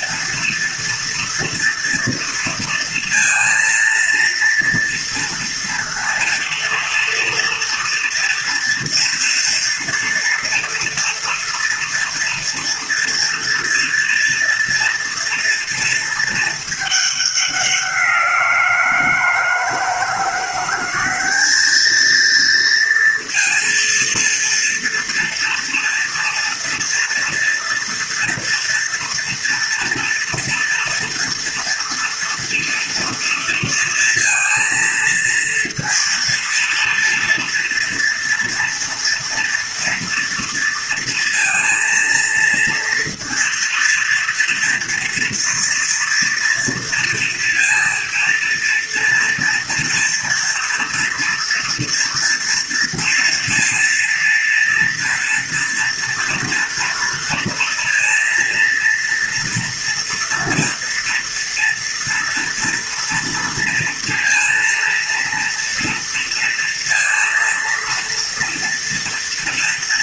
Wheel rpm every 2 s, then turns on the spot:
230, 230, 230, 230, 230, 240, 240, 230, 220, 170, 180, 230, 230, 230, 230, 230, 230, 230, 230, 230, 230, 230, 230, 230, 230, 230, 230, 230, 230, 230, 230, 230, 230, 230, 230.
none